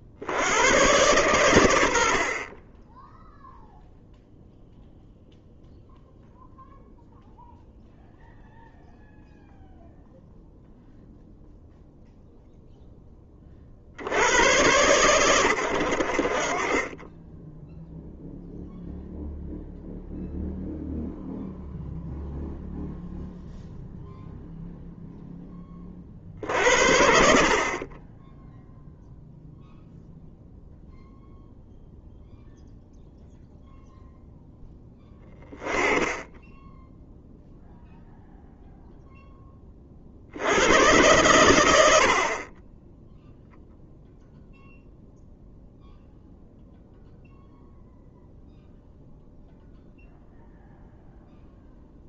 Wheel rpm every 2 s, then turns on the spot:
110, 20, 0, 0, 0, 0, 10, 120, 20, 0, 0, 0, 0, 60, 0, 0, 0, 10, 0, 0, 110, 10, 0, 0, 0, 0.
none